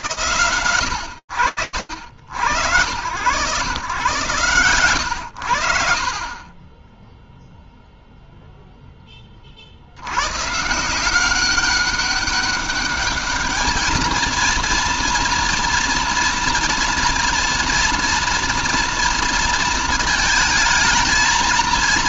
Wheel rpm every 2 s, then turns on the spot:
70, 120, 30, 0, 80, 190, 220, 230, 230, 230, 140.
none